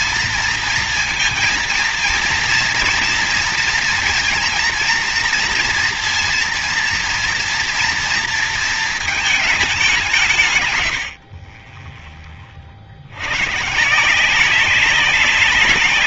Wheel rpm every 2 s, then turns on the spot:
230, 230, 230, 230, 230, 140, 30, 180.
none